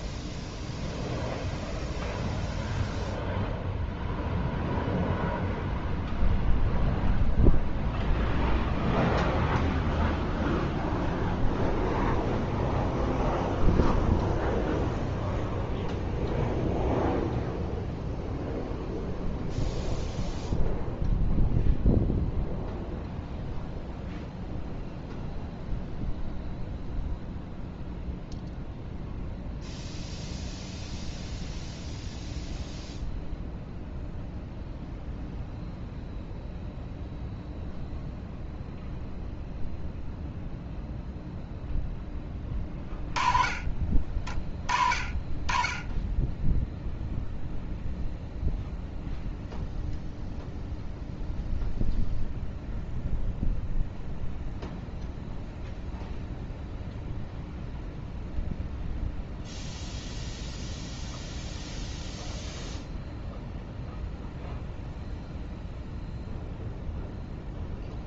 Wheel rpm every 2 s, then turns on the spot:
0, 0, 0, 0, 0, 0, 0, 0, 0, 0, 0, 0, 0, 0, 0, 0, 0, 0, 0, 0, 0, 20, 30, 0, 0, 0, 0, 0, 0, 0, 0, 0, 0, 0.
none